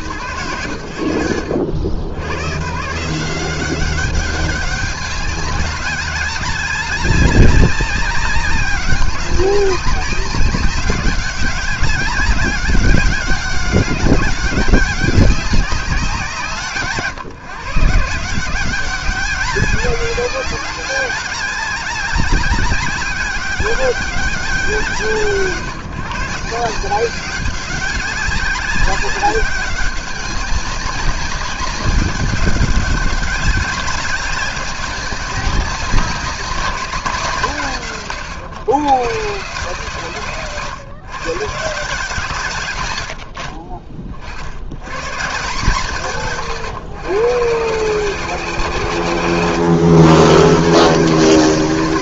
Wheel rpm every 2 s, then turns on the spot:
100, 200, 200, 200, 200, 200, 200, 190, 160, 200, 200, 170, 150, 190, 200, 200, 200, 200, 130, 150, 120, 30, 170, 150, 140, 200.
none